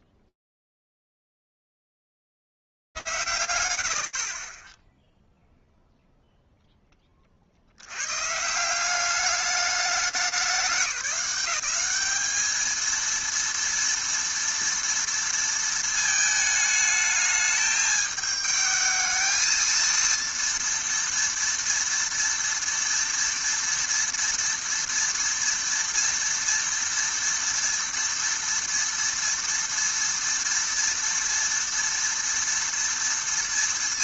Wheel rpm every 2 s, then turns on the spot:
0, 40, 40, 0, 170, 180, 220, 230, 220, 220, 230, 230, 230, 230, 230, 230, 230.
none